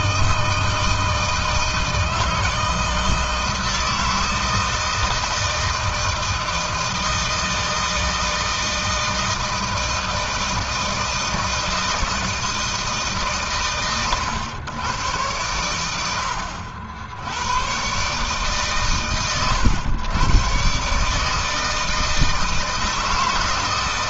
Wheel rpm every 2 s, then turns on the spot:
160, 160, 160, 160, 160, 160, 160, 120, 80, 130, 120, 160.
none